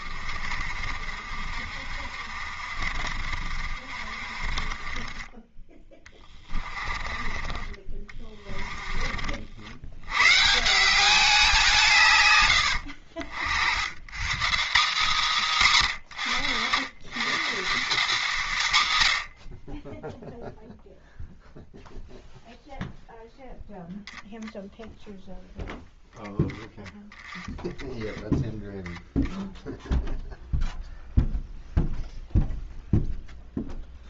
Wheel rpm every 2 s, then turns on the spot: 50, 50, 20, 20, 30, 190, 70, 230, 130, 120, 0, 0, 0, 10, 0, 0, 0.
0-10 12-14